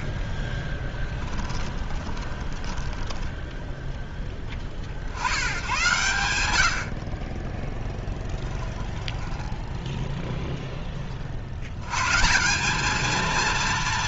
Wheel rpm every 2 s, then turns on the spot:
10, 10, 80, 30, 10, 50, 230.
0-4 8-10